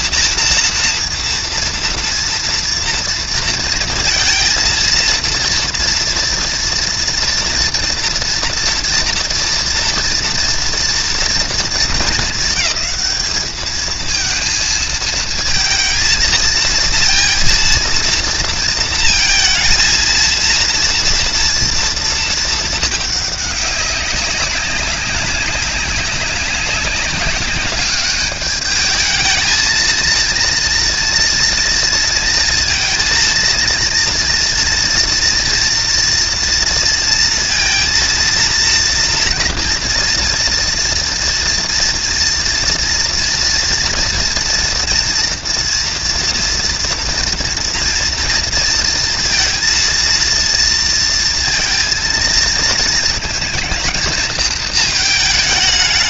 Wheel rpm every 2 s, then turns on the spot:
230, 230, 230, 240, 230, 230, 220, 230, 220, 230, 230, 210, 200, 200, 220, 230, 230, 230, 230, 230, 230, 240, 230, 230, 230, 230, 230, 220.
none